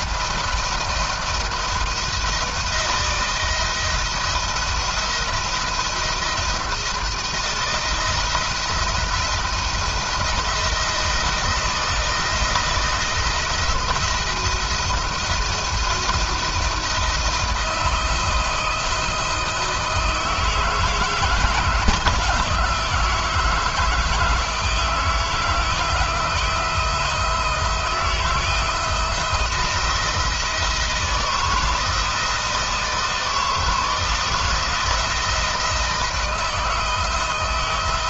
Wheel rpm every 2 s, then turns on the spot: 170, 170, 170, 170, 160, 160, 170, 170, 170, 160, 160, 160, 160, 160, 170, 160, 160, 160, 160.
none